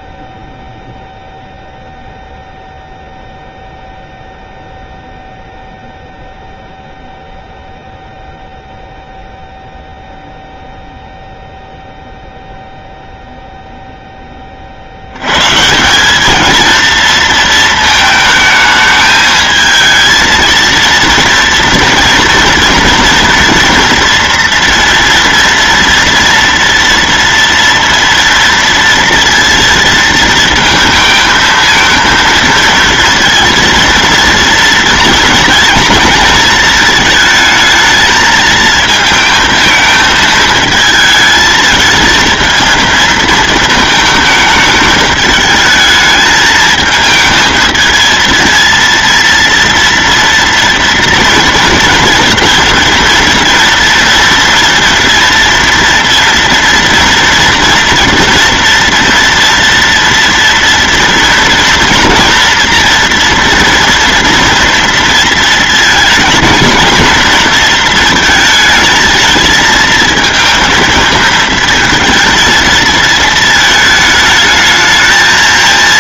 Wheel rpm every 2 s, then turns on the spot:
10, 0, 0, 0, 0, 0, 0, 90, 230, 220, 230, 230, 230, 230, 230, 220, 230, 230, 220, 220, 220, 230, 220, 220, 230, 230, 230, 230, 230, 230, 230, 230, 230, 230, 220, 230, 220, 220.
none